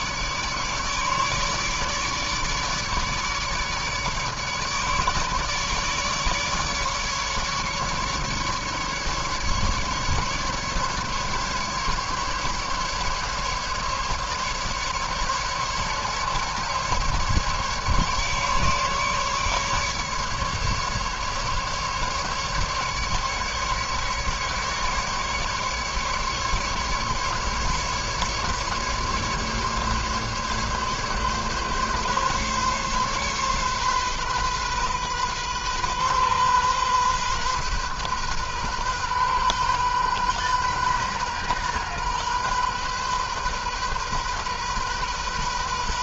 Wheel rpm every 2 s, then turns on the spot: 150, 150, 150, 150, 140, 150, 150, 150, 150, 150, 150, 150, 140, 150, 150, 140, 140, 130, 130, 130, 130, 130, 130.
none